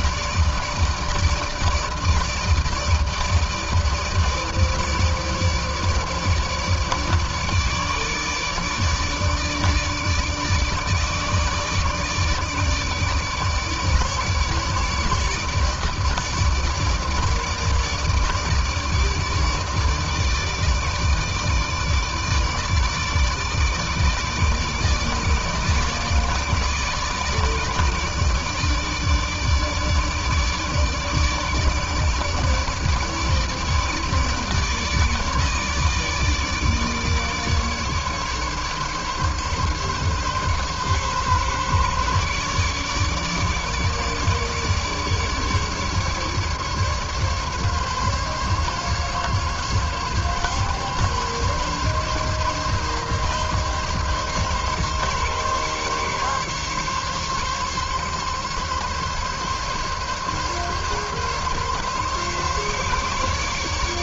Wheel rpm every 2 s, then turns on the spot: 150, 160, 150, 150, 150, 150, 150, 160, 150, 160, 160, 150, 160, 150, 150, 150, 150, 150, 150, 140, 140, 150, 150, 140, 140, 140, 140, 140, 140, 140, 140, 140.
none